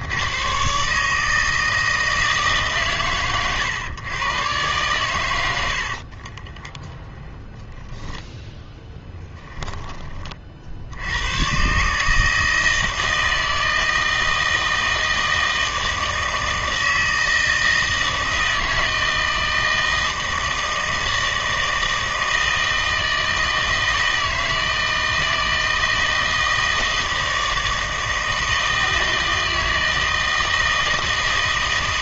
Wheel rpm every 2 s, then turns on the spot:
130, 140, 120, 10, 10, 50, 160, 160, 160, 160, 160, 160, 160, 160, 160, 160.
6-10